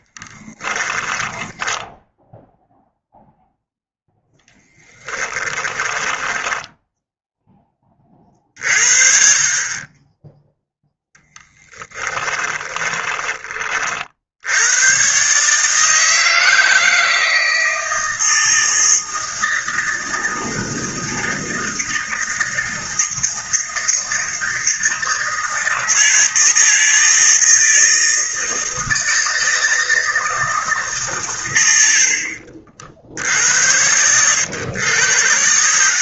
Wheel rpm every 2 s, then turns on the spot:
20, 0, 10, 10, 40, 10, 20, 120, 160, 160, 160, 160, 160, 160, 160, 140, 60, 110.
0-2 4-8 12-14